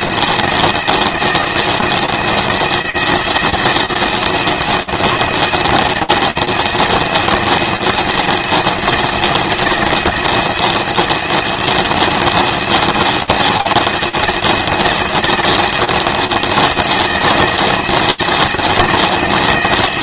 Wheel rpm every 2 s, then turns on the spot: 170, 170, 170, 170, 170, 170, 170, 170, 170, 160.
none